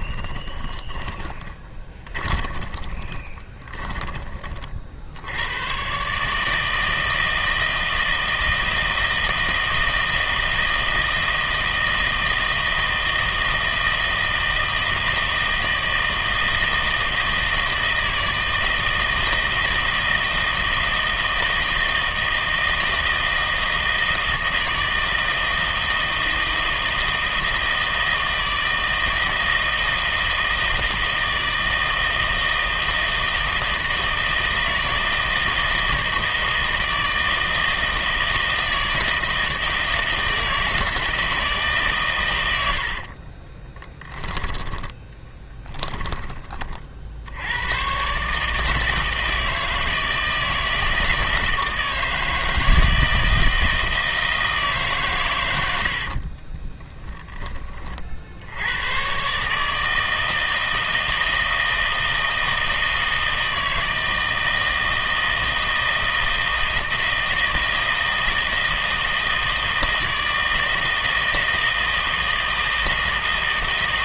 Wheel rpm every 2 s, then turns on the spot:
20, 20, 50, 160, 160, 160, 160, 160, 160, 160, 160, 160, 160, 160, 160, 160, 160, 160, 160, 160, 160, 90, 10, 40, 160, 160, 160, 150, 10, 100, 160, 160, 160, 160, 160, 160, 160.
0-4 42-46 56-58